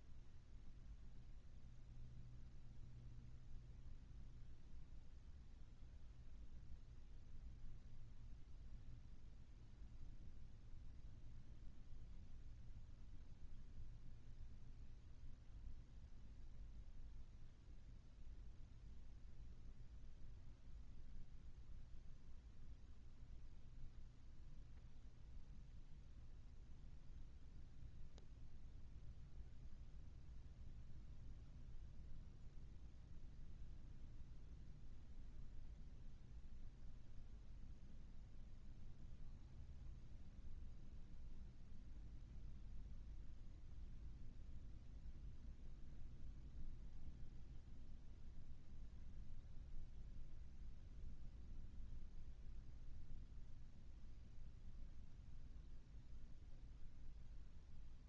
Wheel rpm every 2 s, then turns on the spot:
0, 0, 0, 0, 0, 0, 0, 0, 0, 0, 0, 0, 0, 0, 0, 0, 0, 0, 0, 0, 0, 0, 0, 0, 0, 0, 0, 0, 0.
none